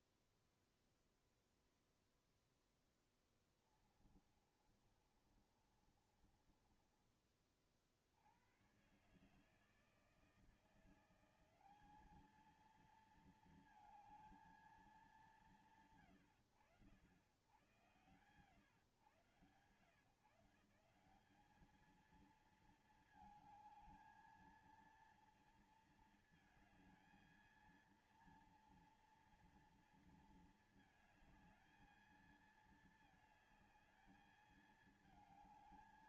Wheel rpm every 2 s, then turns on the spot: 0, 0, 20, 30, 70, 160, 200, 220, 80, 110, 140, 210, 220, 230, 230, 230, 220, 220.
4-8